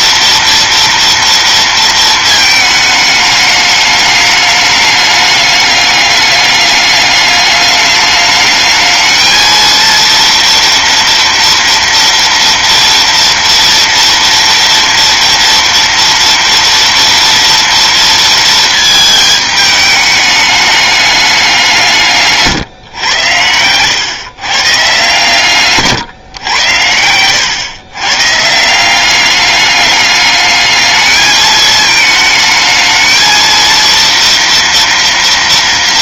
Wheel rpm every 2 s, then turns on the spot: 230, 220, 210, 210, 210, 230, 230, 240, 230, 220, 210, 140, 140, 100, 170, 210, 220, 230.
none